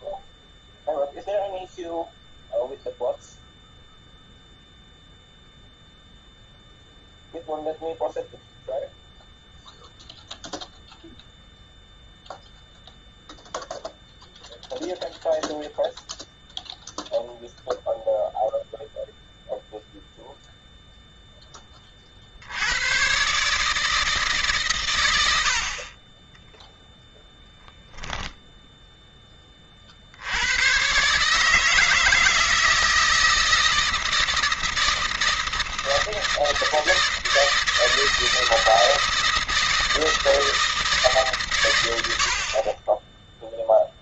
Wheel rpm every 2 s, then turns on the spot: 0, 0, 0, 0, 0, 0, 0, 0, 0, 0, 0, 70, 150, 20, 0, 100, 160, 160, 160, 160, 160, 50.
26-28